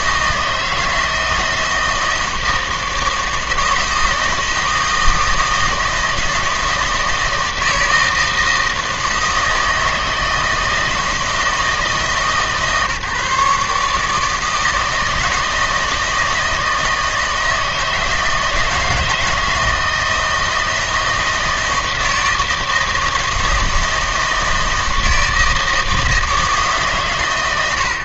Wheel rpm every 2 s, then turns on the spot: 160, 160, 160, 160, 160, 160, 150, 160, 160, 160, 160, 160, 160, 140.
none